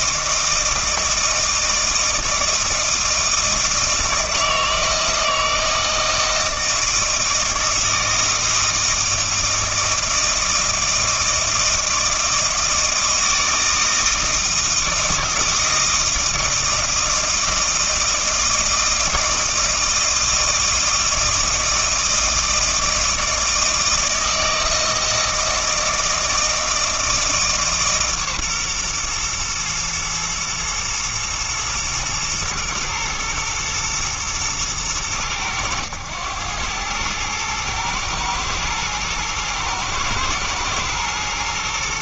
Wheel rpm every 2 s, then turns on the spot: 160, 160, 160, 160, 160, 160, 160, 160, 160, 160, 160, 160, 160, 160, 130, 110, 120, 100, 100, 110, 120.
none